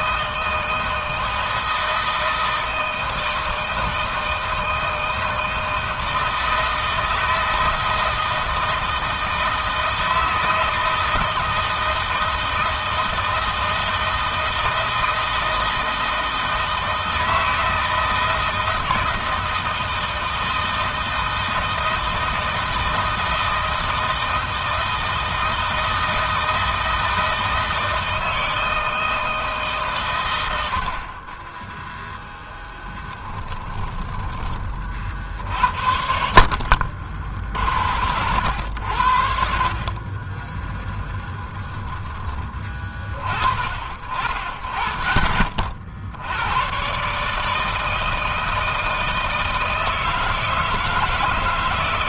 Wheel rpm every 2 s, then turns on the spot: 160, 160, 160, 160, 160, 160, 160, 160, 160, 160, 160, 160, 160, 160, 160, 50, 10, 40, 60, 80, 10, 30, 40, 120, 160, 160.
32-34 40-42